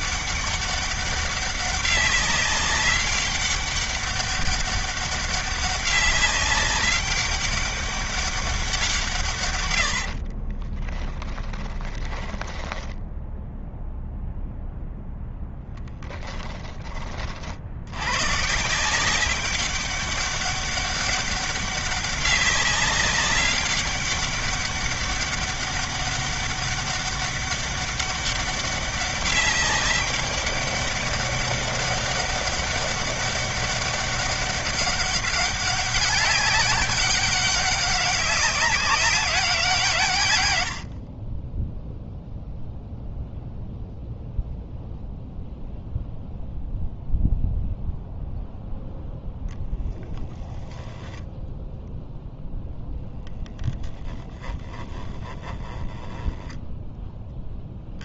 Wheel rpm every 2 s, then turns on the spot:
200, 200, 200, 200, 170, 20, 10, 0, 30, 180, 200, 200, 200, 200, 200, 200, 200, 200, 200, 200, 70, 0, 0, 0, 0, 0, 0, 10, 10.
10-14